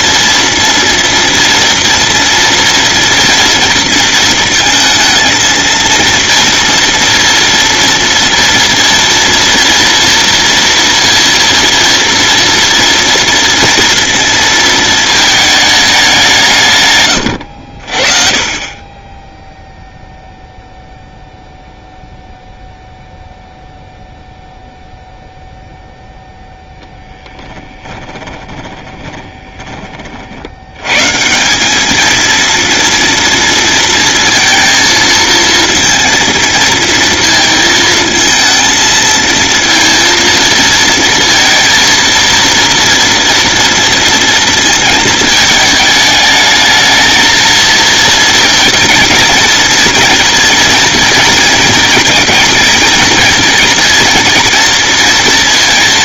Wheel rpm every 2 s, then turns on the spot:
230, 230, 230, 230, 230, 230, 230, 220, 130, 30, 0, 0, 0, 0, 10, 110, 230, 230, 230, 230, 230, 230, 220, 220, 220, 230, 230, 230.
28-30